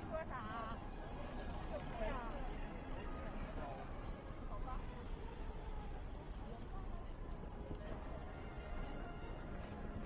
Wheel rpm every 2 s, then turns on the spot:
0, 0, 0, 0, 80.
none